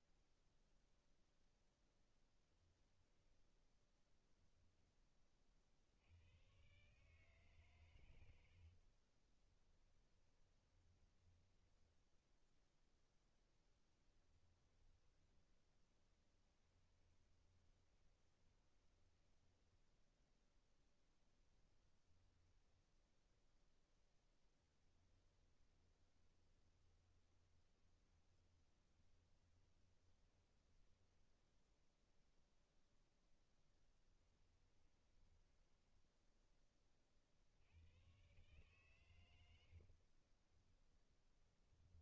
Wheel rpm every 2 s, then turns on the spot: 0, 0, 100, 120, 10, 10, 10, 10, 20, 10, 10, 0, 20, 20, 20, 0, 10, 10, 90, 70, 20.
8-12 14-22 24-30 32-36 38-42